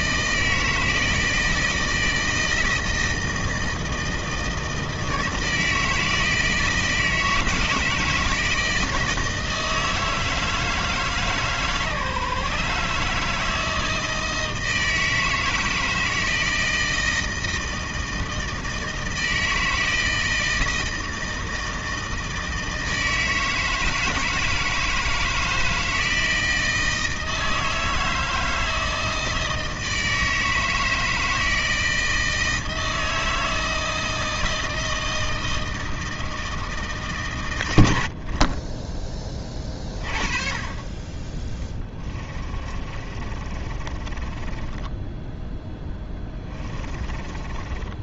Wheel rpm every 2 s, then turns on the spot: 160, 160, 160, 160, 160, 160, 150, 160, 160, 160, 160, 160, 160, 160, 160, 160, 160, 160, 150, 20, 30, 30, 20, 20.
42-48